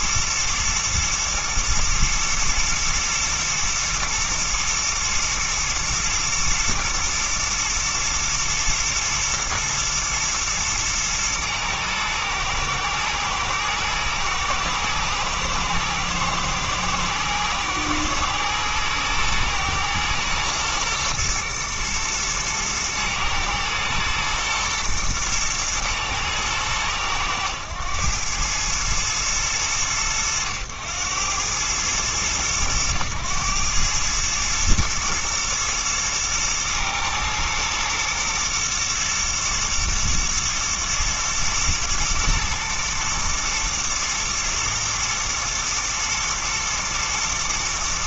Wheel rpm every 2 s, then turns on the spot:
120, 120, 120, 110, 120, 120, 110, 120, 110, 120, 120, 110, 120, 110, 110, 100, 110, 110, 110, 120, 110, 120, 120, 120.
none